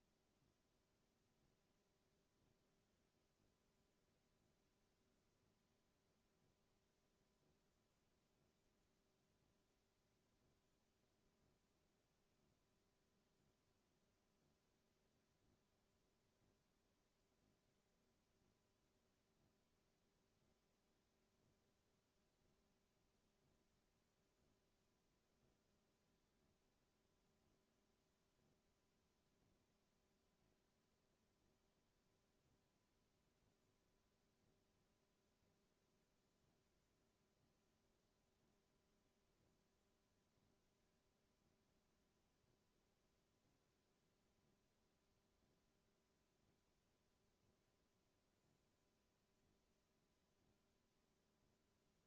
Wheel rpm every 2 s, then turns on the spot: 0, 0, 0, 0, 0, 0, 0, 0, 0, 0, 0, 0, 0, 0, 0, 0, 0, 0, 0, 0, 0, 0, 0, 0, 0, 0.
none